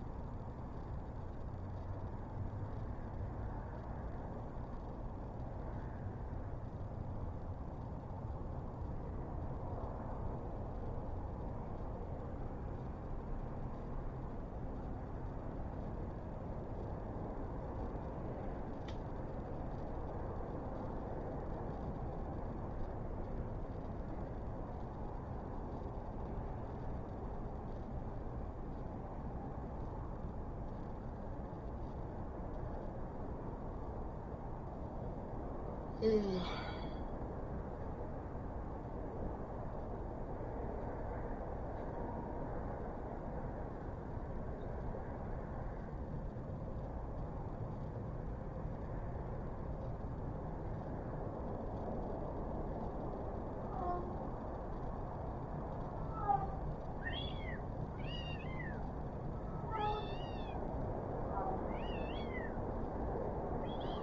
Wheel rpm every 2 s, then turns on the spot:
0, 0, 0, 0, 0, 0, 0, 0, 0, 0, 0, 0, 0, 0, 0, 0, 0, 0, 0, 0, 0, 0, 0, 0, 0, 0, 0, 0, 0, 0, 0, 0.
none